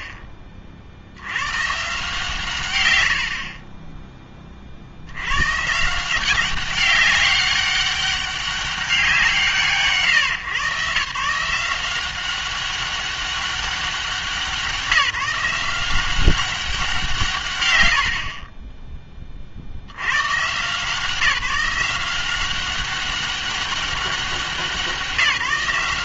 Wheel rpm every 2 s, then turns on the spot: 40, 120, 40, 190, 200, 130, 190, 180, 190, 20, 150, 190, 180.
none